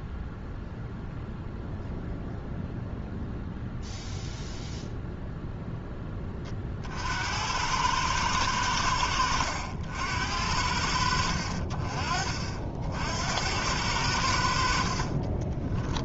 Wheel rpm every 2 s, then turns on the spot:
0, 0, 0, 50, 80, 50, 60, 40.
14-16